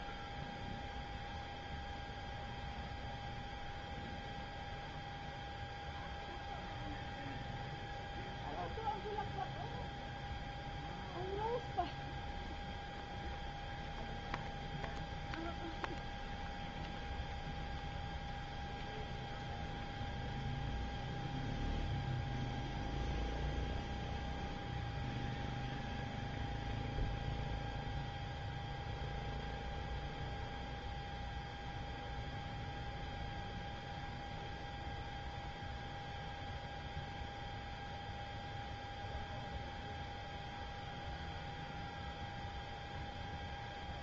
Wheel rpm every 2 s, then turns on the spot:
0, 0, 0, 0, 0, 0, 0, 0, 0, 0, 0, 0, 0, 0, 0, 0, 0, 0, 0, 0, 0, 0.
none